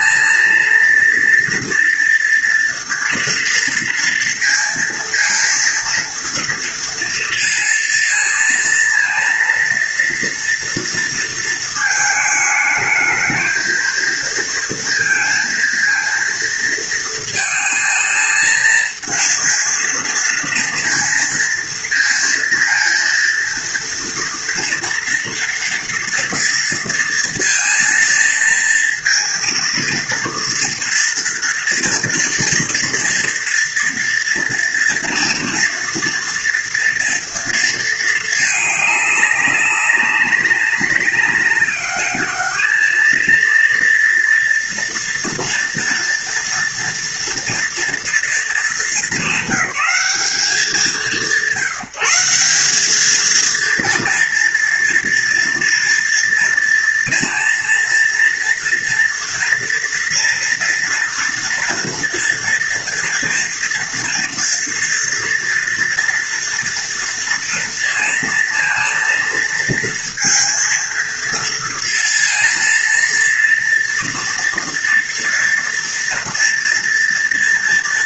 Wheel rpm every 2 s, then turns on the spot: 230, 240, 230, 230, 230, 230, 220, 230, 230, 230, 230, 230, 240, 230, 230, 240, 240, 230, 230, 210, 190, 210, 230, 230, 230, 190, 190, 230, 230, 230, 230, 230, 230, 230, 230, 230, 230, 230, 240.
none